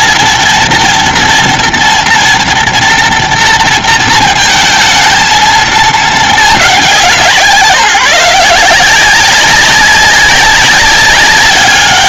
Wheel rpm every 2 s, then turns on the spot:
230, 230, 220, 180, 180, 200.
none